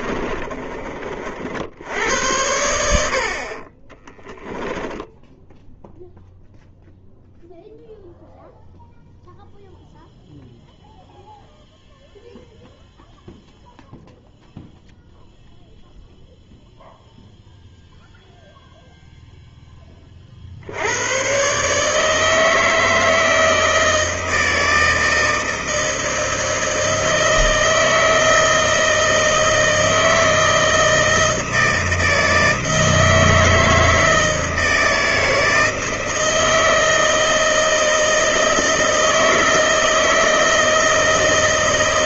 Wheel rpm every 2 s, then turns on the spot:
30, 90, 10, 0, 0, 0, 0, 0, 0, 0, 60, 160, 160, 160, 160, 160, 160, 160, 160, 160, 160.
0-2